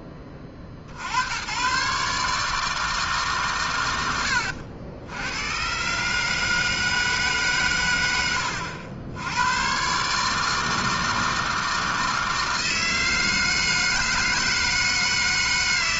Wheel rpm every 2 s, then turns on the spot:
70, 150, 70, 160, 90, 160, 160, 160.
none